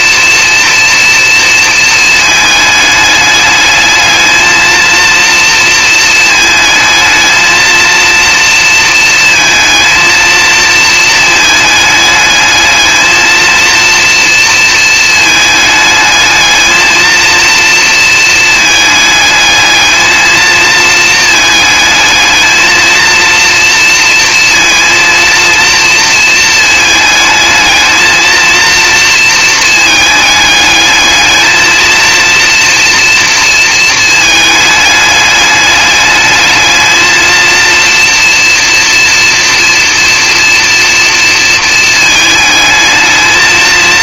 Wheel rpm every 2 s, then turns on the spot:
230, 210, 230, 220, 230, 230, 220, 230, 220, 220, 220, 230, 230, 220, 230, 210, 230, 210, 220, 230, 230, 220.
none